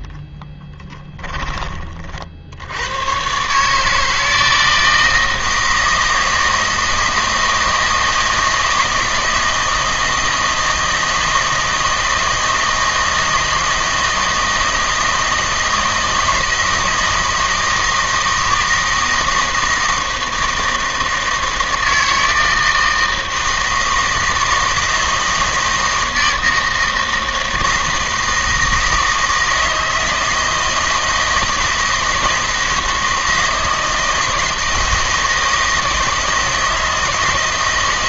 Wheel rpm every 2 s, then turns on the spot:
10, 80, 160, 160, 160, 160, 160, 160, 160, 160, 160, 160, 160, 160, 160, 160, 160, 160, 160.
0-2